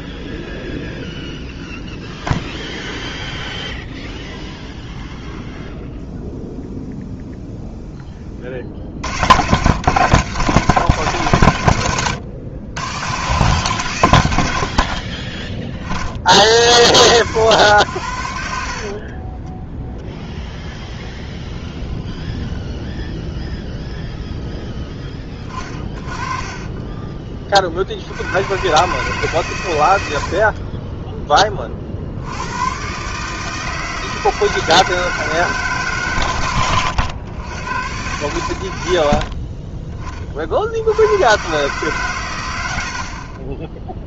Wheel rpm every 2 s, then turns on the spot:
0, 0, 0, 0, 70, 130, 90, 40, 90, 40, 0, 10, 10, 20, 130, 20, 130, 160, 100, 80, 80, 60.
18-20 26-28